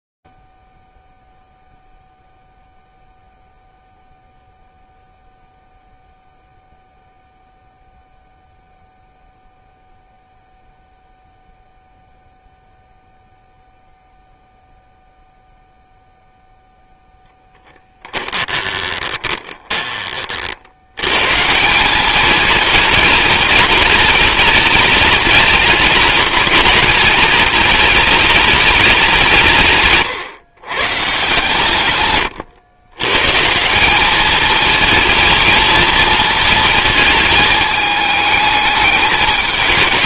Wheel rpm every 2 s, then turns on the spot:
0, 0, 0, 0, 0, 0, 0, 0, 0, 20, 110, 220, 210, 210, 200, 140, 120, 230, 220, 210.
18-20